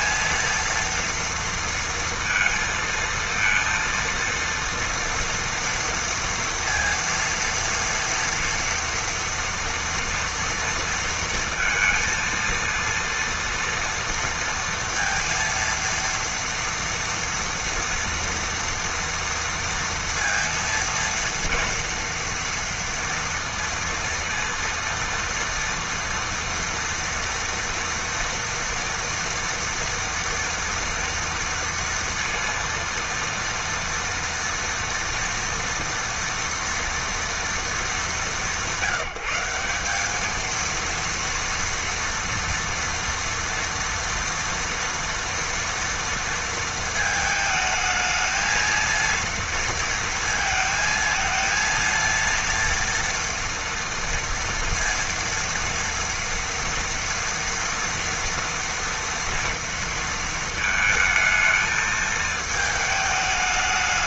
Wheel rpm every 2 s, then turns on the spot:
230, 230, 230, 230, 230, 230, 230, 230, 230, 230, 230, 230, 230, 230, 230, 230, 230, 230, 230, 180, 230, 230, 230, 220, 220, 220, 230, 230, 230, 230, 220, 220.
none